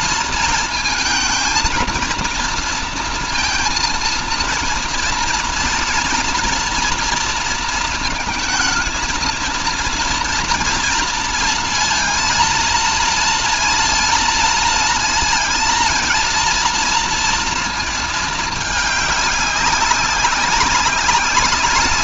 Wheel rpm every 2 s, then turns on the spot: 230, 230, 230, 230, 220, 230, 230, 230, 230, 210, 200.
none